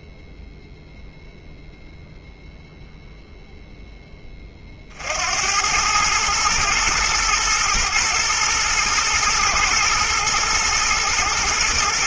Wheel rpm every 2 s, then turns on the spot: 0, 0, 40, 110, 120, 120.
none